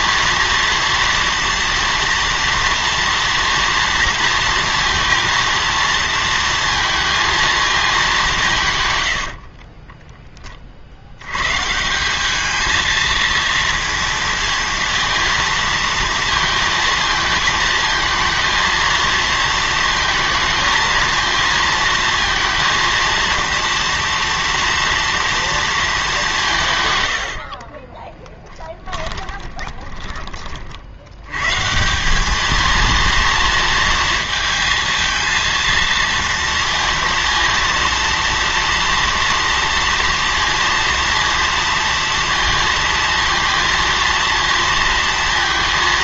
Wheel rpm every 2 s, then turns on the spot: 230, 230, 230, 230, 150, 40, 220, 230, 220, 230, 230, 230, 230, 150, 10, 60, 230, 230, 230, 230, 230, 230, 230.
28-30